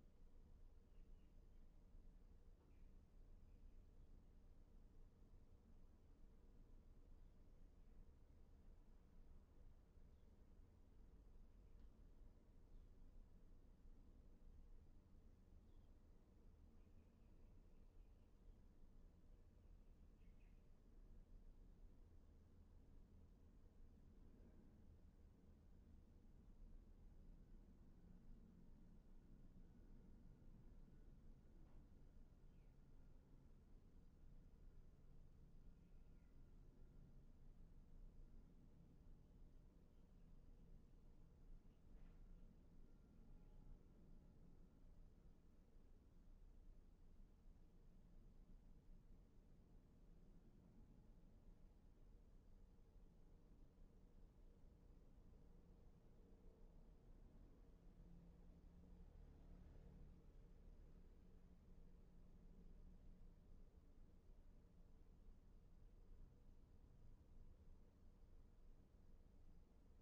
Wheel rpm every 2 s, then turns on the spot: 0, 0, 0, 0, 0, 0, 0, 0, 0, 0, 0, 0, 0, 0, 0, 0, 0, 0, 0, 0, 0, 0, 0, 0, 0, 0, 0, 0, 0, 0, 0, 0, 0, 0, 0.
none